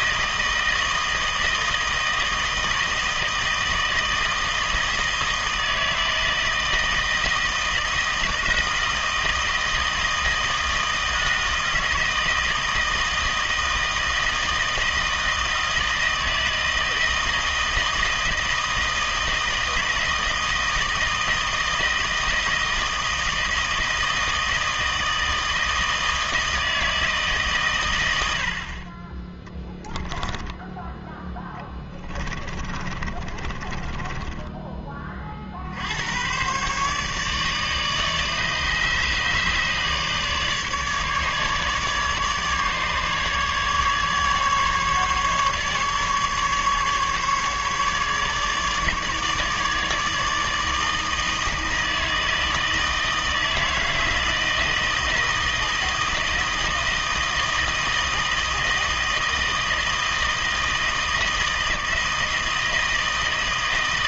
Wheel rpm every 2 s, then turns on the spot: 160, 160, 160, 160, 160, 160, 160, 160, 160, 160, 160, 160, 160, 160, 50, 10, 20, 20, 130, 150, 150, 150, 150, 150, 150, 160, 160, 160, 160, 160, 160, 160.
28-30 32-34